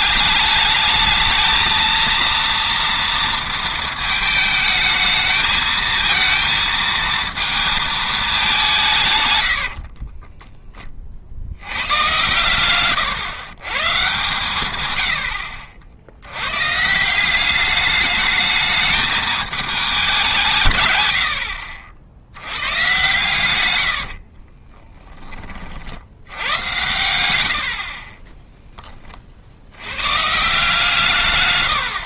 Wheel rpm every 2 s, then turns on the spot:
220, 230, 220, 230, 160, 20, 130, 100, 150, 220, 110, 120, 20, 120, 10, 160.
24-28